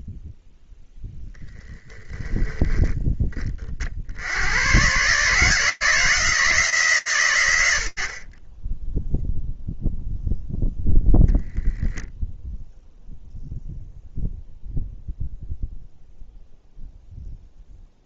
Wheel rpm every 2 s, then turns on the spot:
0, 10, 110, 160, 20, 0, 0, 0, 0.
none